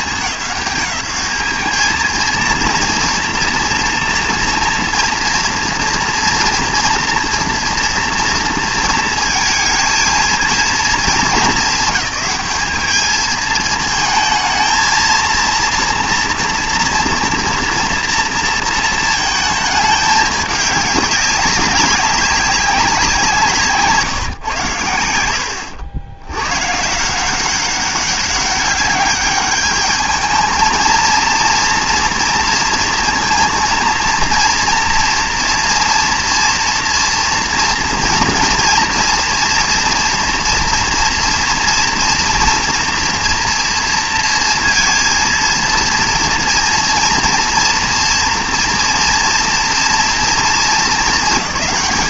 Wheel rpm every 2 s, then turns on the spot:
200, 230, 230, 230, 230, 220, 210, 230, 230, 230, 200, 190, 110, 100, 200, 220, 230, 230, 230, 230, 230, 230, 230, 240, 240, 230.
none